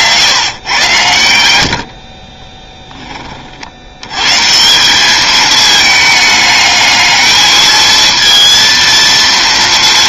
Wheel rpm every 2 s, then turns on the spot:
120, 20, 170, 210, 230.
none